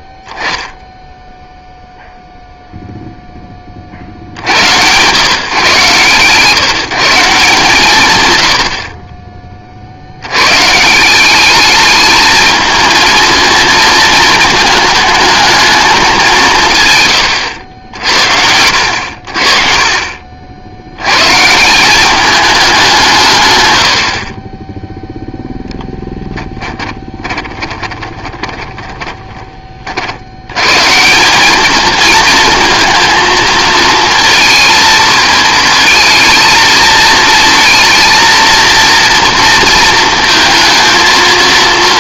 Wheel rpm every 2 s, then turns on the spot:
10, 0, 70, 150, 70, 140, 230, 220, 150, 70, 90, 200, 0, 10, 20, 150, 230, 220, 220, 240, 230.
26-30